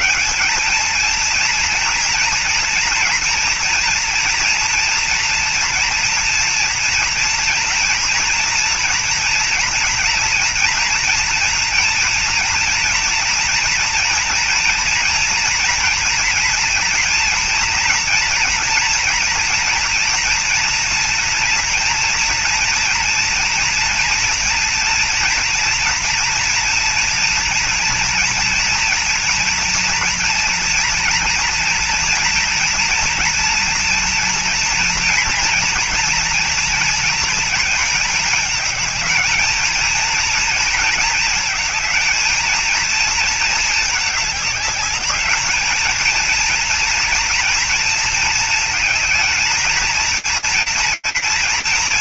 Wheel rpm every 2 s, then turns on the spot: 210, 230, 230, 230, 230, 230, 230, 230, 230, 230, 230, 230, 230, 230, 230, 230, 230, 230, 230, 220, 220, 220, 210, 230, 220, 230.
none